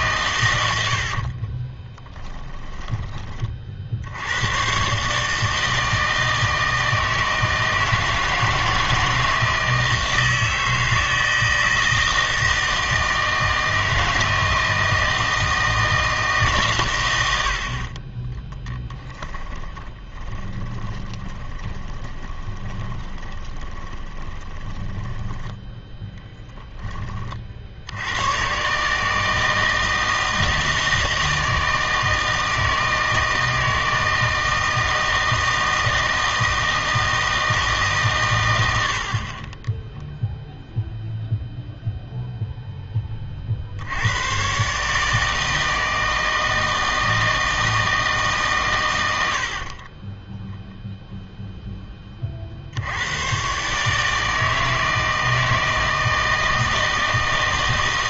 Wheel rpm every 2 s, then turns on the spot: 80, 20, 120, 160, 160, 160, 160, 160, 130, 10, 20, 20, 10, 10, 140, 160, 160, 160, 160, 90, 0, 0, 140, 160, 110, 0, 70, 160, 160.
2-4 18-26